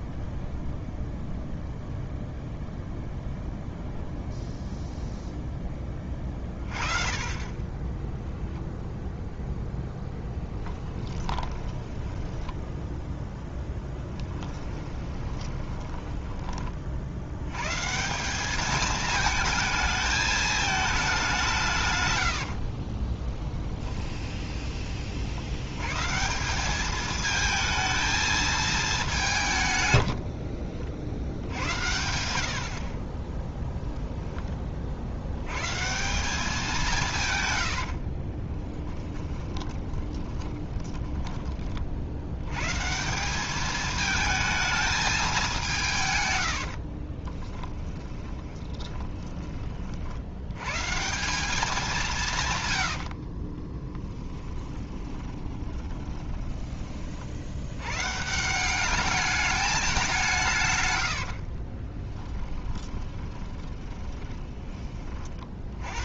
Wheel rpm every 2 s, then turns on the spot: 0, 0, 0, 40, 0, 20, 10, 20, 60, 220, 210, 30, 40, 210, 210, 60, 40, 60, 170, 10, 20, 160, 220, 50, 10, 140, 80, 20, 30, 210, 100, 20, 30.
10-16 22-24 38-42 46-50 52-56 60-64